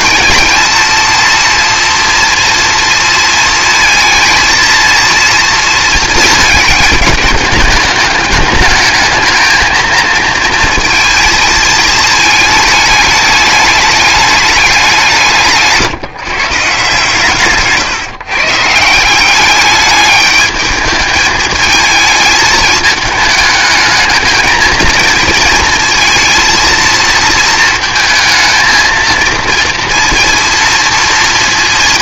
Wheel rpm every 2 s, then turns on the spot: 230, 230, 230, 220, 220, 230, 210, 200, 140, 160, 210, 210, 220, 230, 220, 230.
none